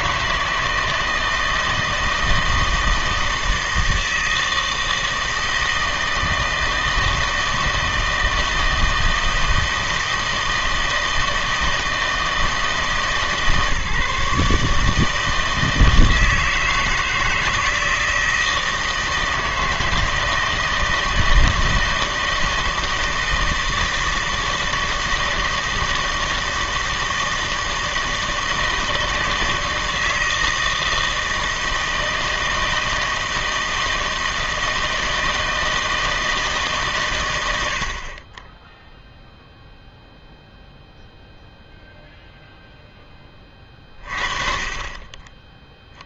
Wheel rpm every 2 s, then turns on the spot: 160, 160, 160, 160, 160, 160, 160, 150, 160, 160, 160, 160, 160, 160, 160, 160, 160, 160, 140, 0, 0, 0, 30.
none